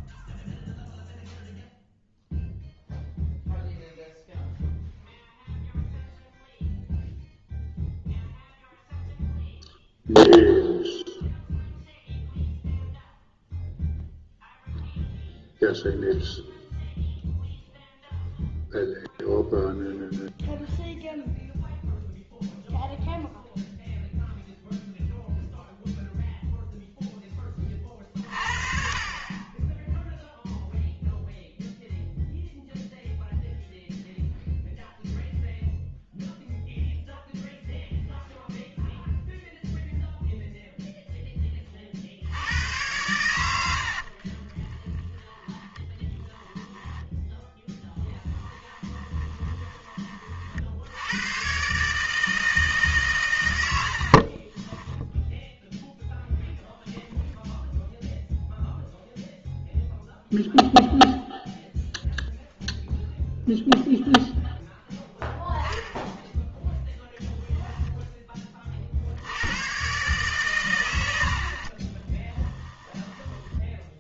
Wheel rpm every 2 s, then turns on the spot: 0, 0, 0, 0, 0, 0, 0, 0, 0, 0, 0, 0, 0, 0, 40, 0, 0, 0, 0, 0, 0, 110, 20, 10, 10, 60, 160, 20, 10, 0, 0, 0, 0, 0, 40, 100, 20.
44-46 48-50 54-56 72-74